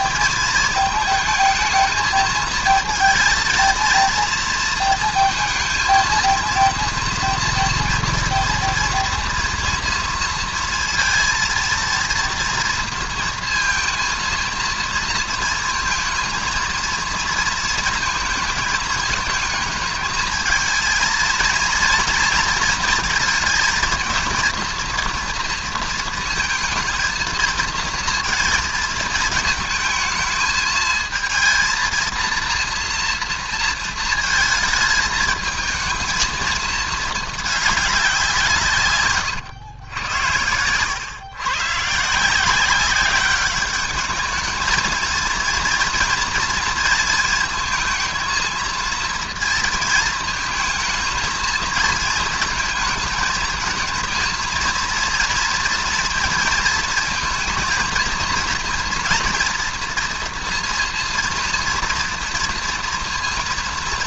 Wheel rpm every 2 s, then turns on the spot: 220, 220, 230, 230, 240, 230, 230, 230, 230, 220, 220, 230, 230, 230, 230, 220, 230, 220, 220, 160, 110, 180, 220, 230, 230, 220, 220, 230, 230, 230, 230, 230.
40-42